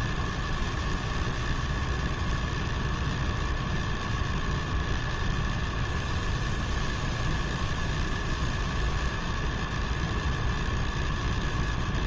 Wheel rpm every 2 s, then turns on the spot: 0, 0, 0, 0, 0, 0.
none